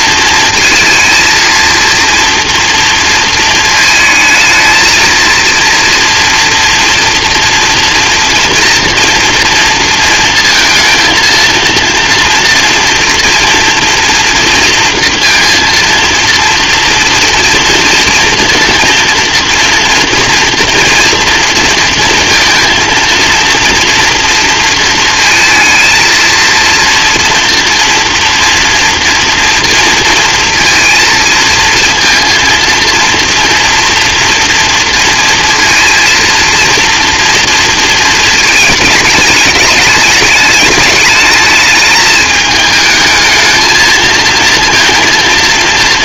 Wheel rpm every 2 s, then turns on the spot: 230, 230, 220, 230, 230, 230, 230, 230, 230, 230, 230, 230, 230, 230, 230, 230, 230, 230, 230, 220, 210, 220, 230.
none